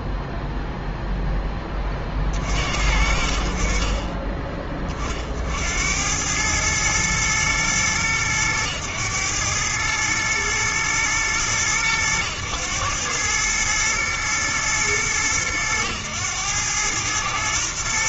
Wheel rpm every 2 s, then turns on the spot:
0, 60, 30, 110, 110, 110, 100, 110, 110.
none